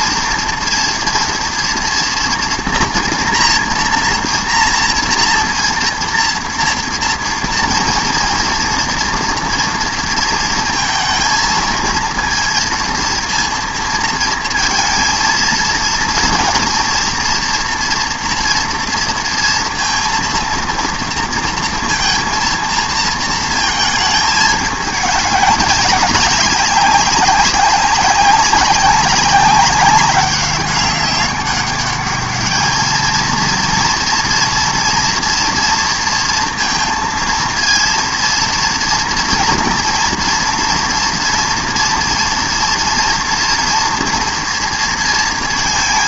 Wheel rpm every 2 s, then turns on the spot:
230, 240, 230, 230, 230, 220, 230, 230, 230, 230, 230, 230, 220, 200, 200, 200, 210, 230, 230, 230, 230, 230, 230.
none